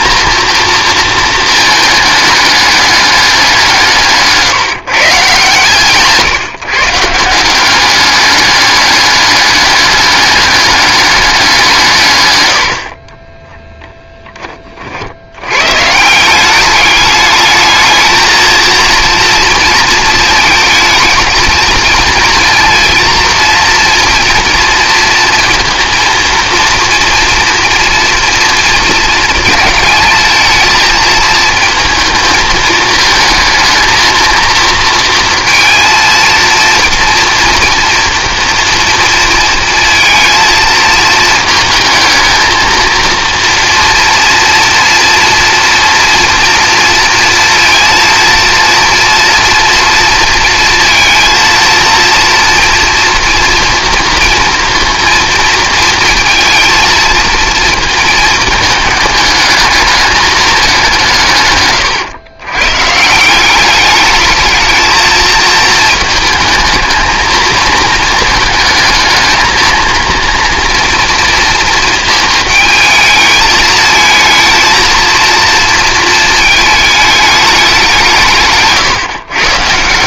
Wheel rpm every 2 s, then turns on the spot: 220, 200, 150, 170, 210, 210, 50, 60, 210, 230, 220, 230, 230, 230, 220, 220, 220, 230, 240, 230, 220, 230, 240, 230, 230, 230, 230, 230, 220, 210, 170, 150, 220, 220, 220, 230, 220, 230, 210, 130.
12-14